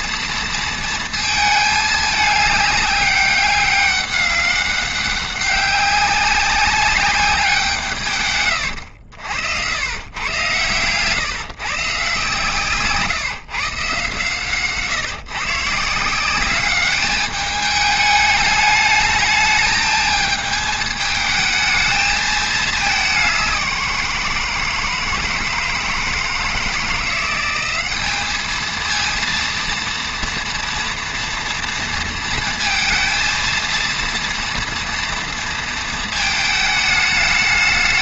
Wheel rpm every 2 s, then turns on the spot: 220, 200, 200, 190, 90, 130, 150, 140, 210, 210, 220, 200, 160, 180, 230, 240, 230, 230, 220.
8-10